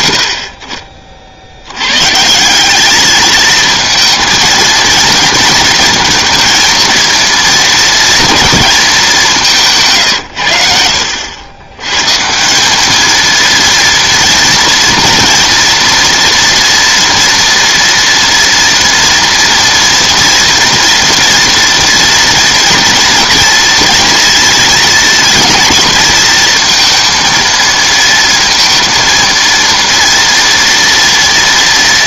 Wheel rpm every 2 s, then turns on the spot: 70, 200, 220, 230, 230, 80, 210, 230, 230, 230, 230, 230, 230, 220, 230, 230.
none